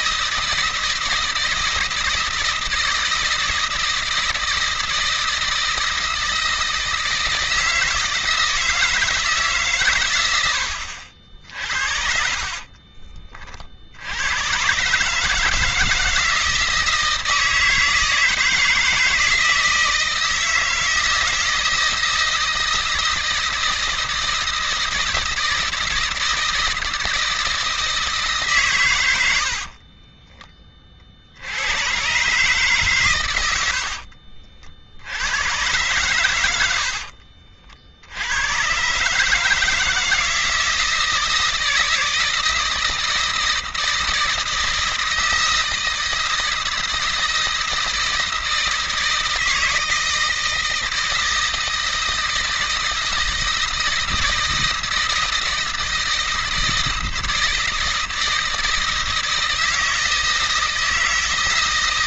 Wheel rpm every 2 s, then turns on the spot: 160, 160, 160, 160, 160, 100, 40, 110, 160, 160, 160, 160, 160, 160, 140, 20, 140, 60, 90, 100, 160, 160, 160, 160, 160, 160, 160, 160, 160, 160, 160.
12-14